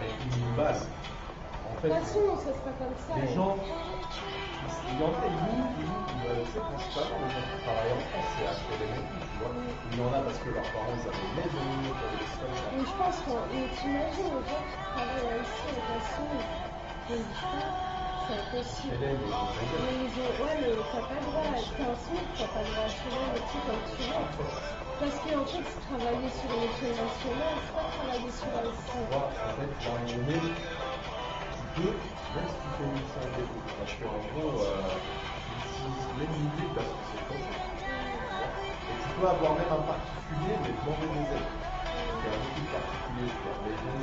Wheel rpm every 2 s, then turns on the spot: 0, 0, 0, 0, 0, 0, 0, 0, 0, 0, 0, 0, 0, 0, 0, 0, 0, 0, 0, 0, 0, 0.
none